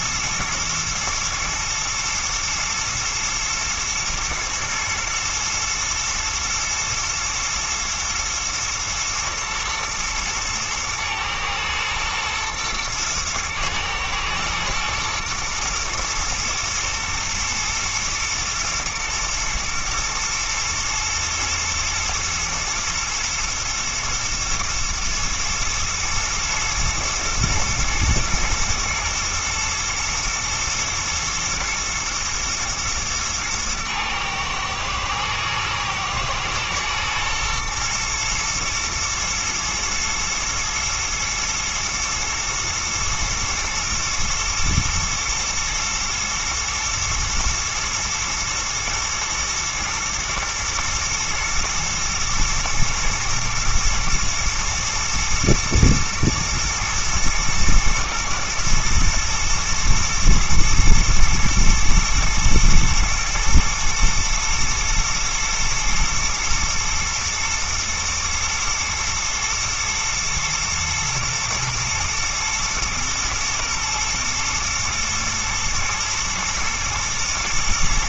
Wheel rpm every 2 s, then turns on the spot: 120, 110, 110, 110, 120, 110, 110, 110, 120, 110, 110, 120, 120, 120, 120, 120, 120, 110, 120, 120, 120, 120, 110, 120, 110, 120, 120, 120, 120, 110, 120, 120, 110, 120, 120, 120, 110, 110, 110.
none